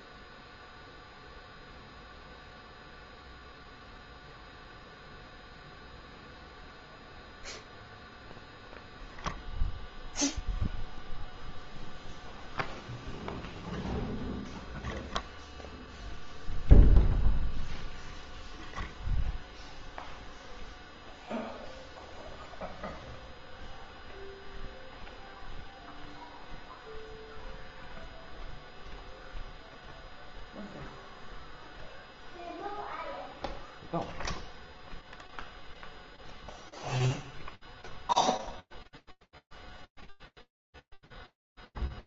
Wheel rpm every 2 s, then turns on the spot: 0, 0, 0, 0, 0, 0, 0, 0, 0, 0, 0, 0, 0, 0, 0, 0, 0, 0, 0, 0, 0.
none